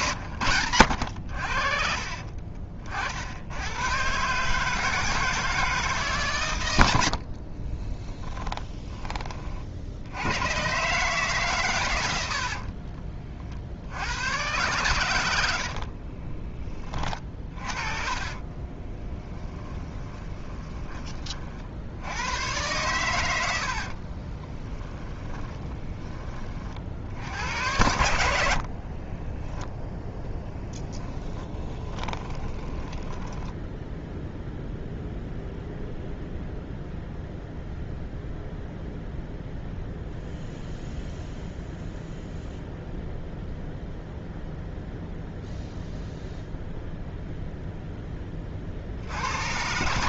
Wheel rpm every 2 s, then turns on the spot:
100, 50, 160, 80, 20, 130, 40, 100, 30, 20, 20, 110, 20, 70, 40, 20, 10, 0, 0, 0, 0, 0, 0, 0, 60.
12-14 18-20 24-26 28-34